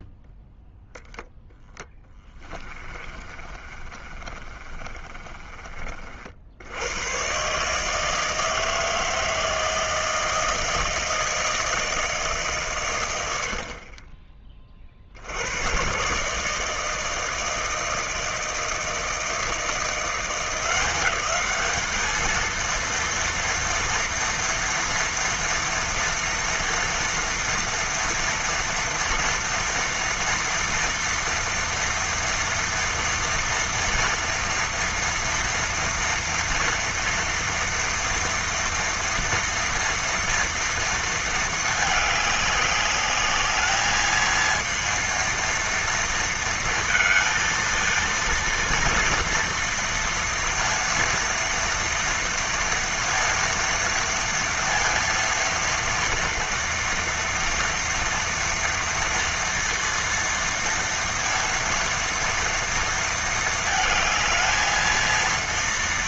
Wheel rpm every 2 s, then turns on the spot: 0, 30, 30, 90, 160, 160, 140, 40, 160, 160, 190, 230, 230, 230, 230, 230, 230, 230, 230, 230, 230, 200, 230, 230, 230, 230, 230, 230, 230, 230, 230, 230, 220.
2-6